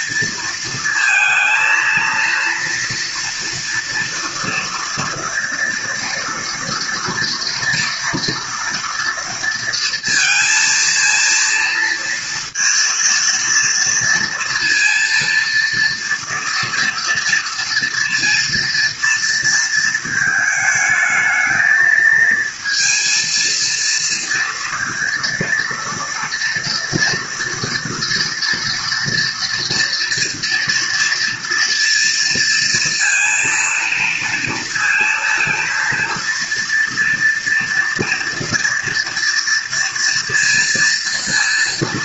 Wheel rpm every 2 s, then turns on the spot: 230, 230, 230, 230, 230, 230, 230, 230, 230, 230, 220, 220, 230, 230, 230, 230, 230, 230, 230, 230, 230.
none